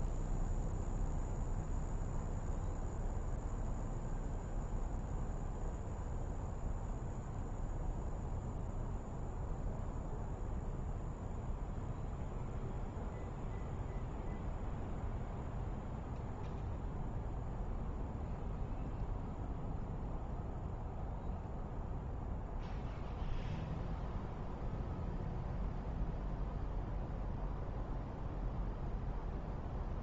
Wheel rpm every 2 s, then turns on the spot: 0, 0, 0, 0, 0, 0, 0, 0, 0, 0, 0, 0, 0, 0, 0.
none